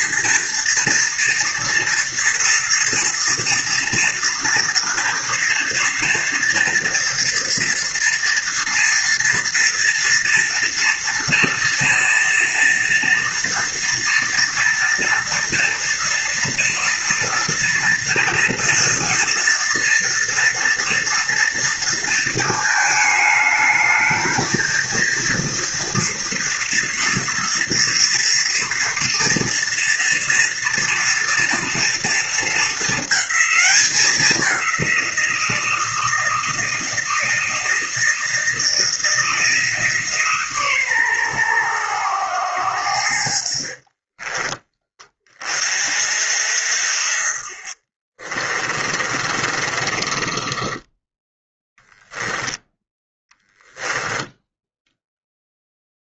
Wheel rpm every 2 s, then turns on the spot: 230, 230, 230, 240, 230, 240, 230, 230, 230, 230, 230, 220, 220, 230, 230, 230, 230, 190, 160, 160, 150, 100, 20, 50, 40, 20, 10, 0.
44-46 48-52